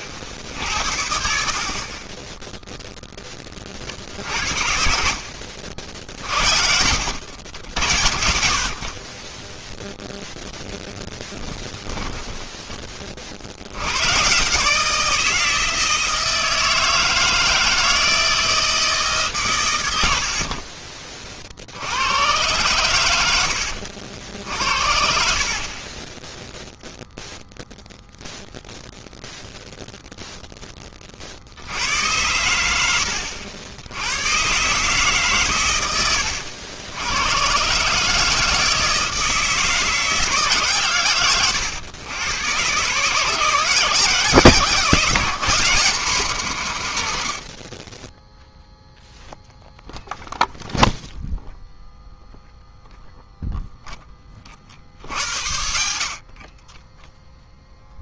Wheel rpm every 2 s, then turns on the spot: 70, 0, 60, 80, 40, 0, 10, 150, 160, 160, 40, 110, 60, 0, 0, 10, 90, 130, 80, 160, 130, 120, 160, 130, 0, 0, 0, 50, 20.
20-22